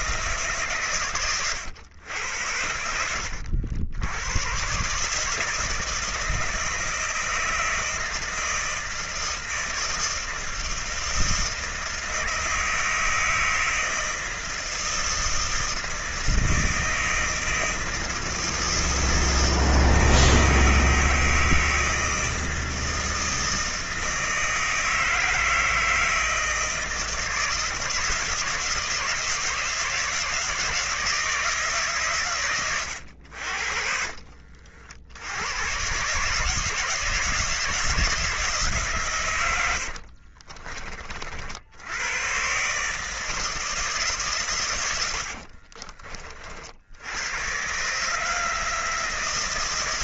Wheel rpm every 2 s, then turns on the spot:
140, 80, 130, 160, 160, 160, 160, 160, 160, 160, 160, 160, 160, 160, 150, 160, 110, 50, 150, 150, 40, 140, 110, 70, 160.
32-34